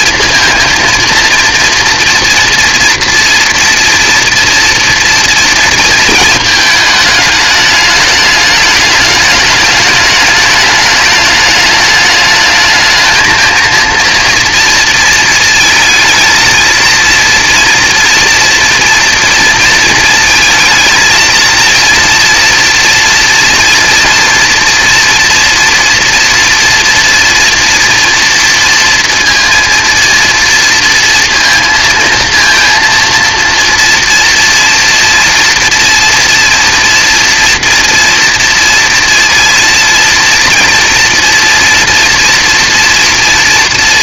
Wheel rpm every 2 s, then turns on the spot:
230, 230, 230, 220, 210, 210, 210, 230, 230, 240, 230, 230, 230, 230, 230, 230, 230, 230, 230, 230, 230, 230.
none